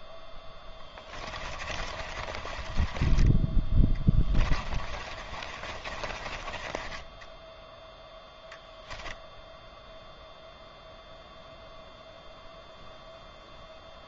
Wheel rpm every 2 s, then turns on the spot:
10, 20, 30, 20, 0, 0, 0.
0-6